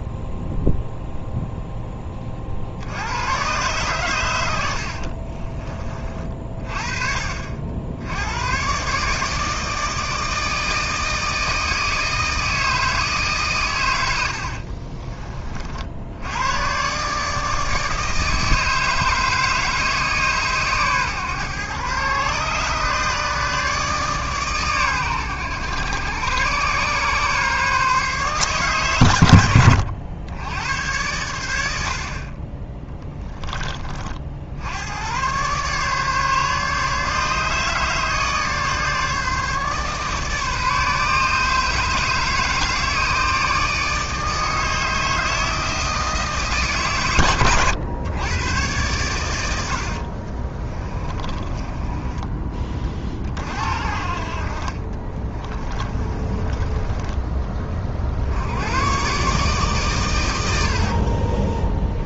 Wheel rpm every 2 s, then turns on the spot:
0, 70, 60, 40, 130, 160, 160, 40, 130, 160, 130, 140, 110, 120, 100, 90, 20, 90, 150, 150, 150, 150, 160, 130, 110, 30, 30, 30, 20, 110, 60.
4-6 14-16 50-52 54-56 60-62